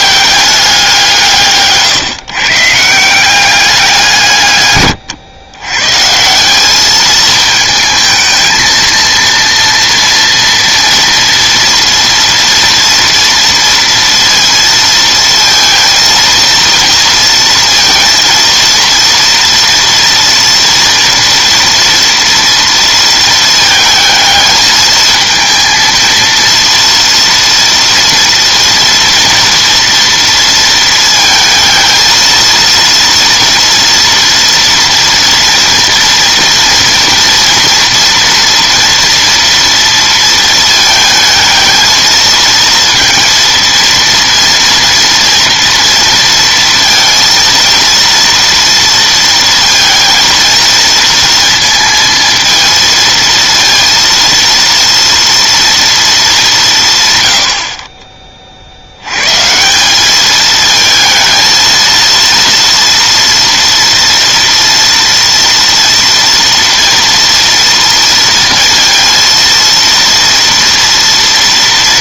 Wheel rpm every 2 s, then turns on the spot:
190, 140, 130, 200, 220, 230, 230, 230, 230, 230, 230, 230, 220, 230, 230, 230, 230, 230, 230, 230, 220, 230, 230, 230, 230, 230, 230, 230, 170, 60, 220, 230, 230, 230, 230, 230.
none